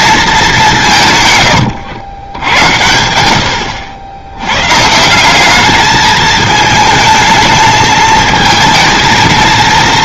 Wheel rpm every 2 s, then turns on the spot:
180, 90, 150, 220, 230.
none